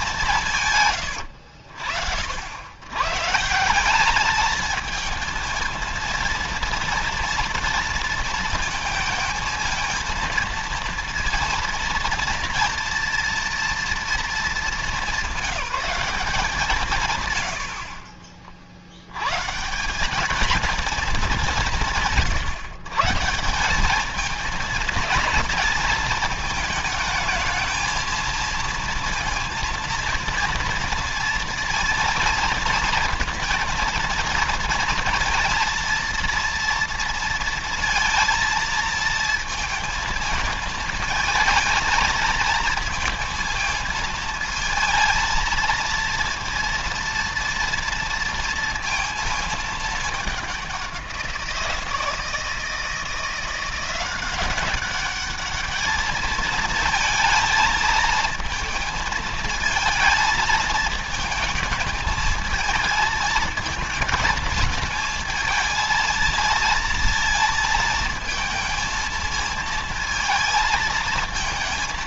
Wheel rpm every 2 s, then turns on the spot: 150, 90, 220, 230, 230, 230, 230, 210, 160, 50, 220, 140, 220, 220, 230, 230, 230, 230, 230, 230, 220, 220, 230, 230, 230, 190, 160, 190, 220, 220, 230, 220, 230, 230, 220, 230.
none